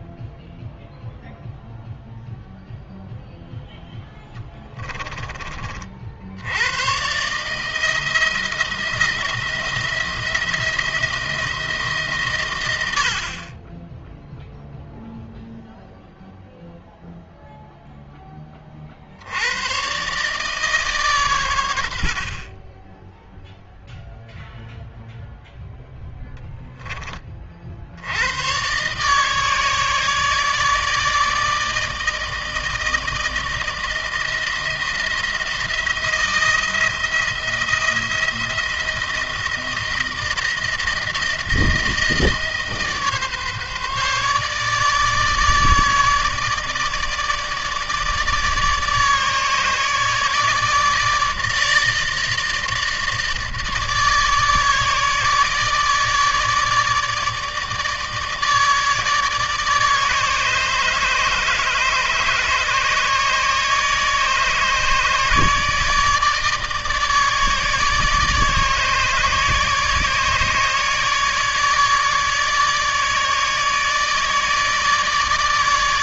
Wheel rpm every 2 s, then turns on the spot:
0, 0, 10, 110, 170, 170, 100, 0, 0, 50, 140, 10, 0, 10, 130, 160, 160, 170, 170, 160, 160, 150, 150, 150, 150, 150, 160, 150, 150, 150, 150, 150, 150, 150, 150, 150, 160, 160.
none